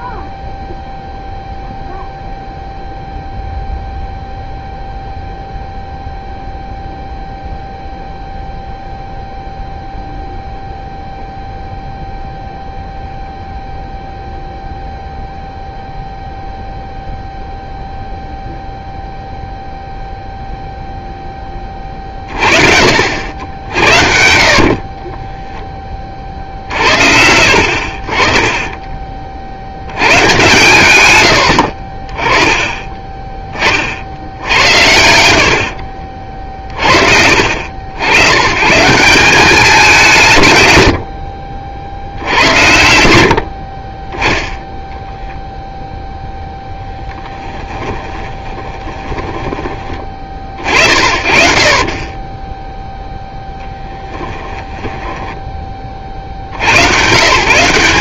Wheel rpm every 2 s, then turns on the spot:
0, 0, 0, 0, 0, 0, 0, 0, 0, 0, 0, 50, 40, 50, 20, 130, 20, 80, 40, 140, 130, 80, 0, 10, 20, 40, 10, 10, 90.
24-26 48-50 52-56